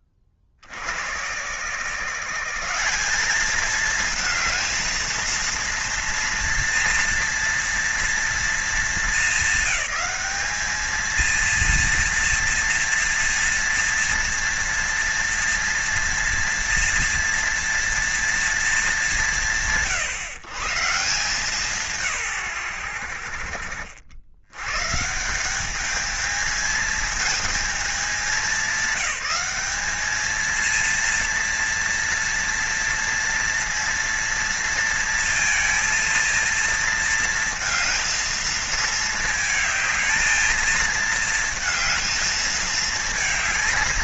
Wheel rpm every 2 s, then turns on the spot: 70, 180, 230, 230, 220, 210, 230, 230, 230, 220, 140, 110, 120, 220, 210, 230, 230, 230, 230, 220, 220, 220.
none